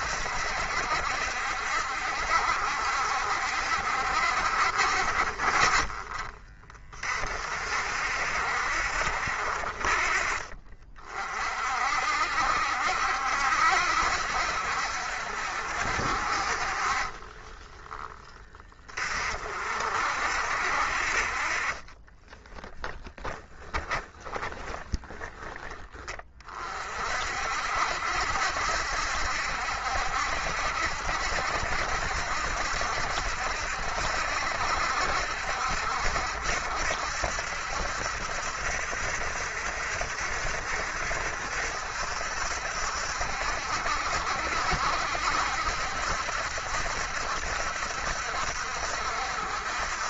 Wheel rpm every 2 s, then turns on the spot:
70, 60, 50, 30, 60, 40, 60, 70, 40, 30, 60, 20, 20, 40, 70, 70, 70, 70, 70, 70, 70, 70, 70, 70, 70.
22-26